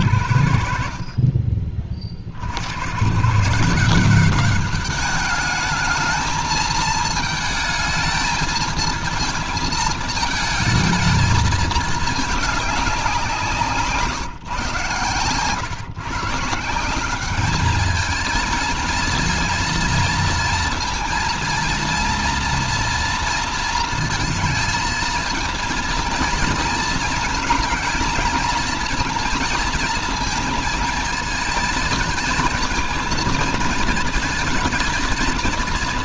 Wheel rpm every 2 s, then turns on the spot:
60, 90, 200, 220, 220, 220, 200, 130, 180, 230, 230, 240, 230, 220, 230, 220, 230, 220.
none